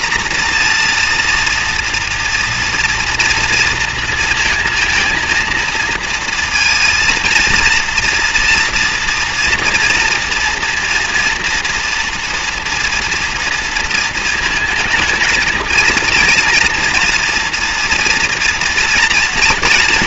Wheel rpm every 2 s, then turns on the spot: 240, 230, 230, 230, 230, 230, 230, 220, 230, 230.
none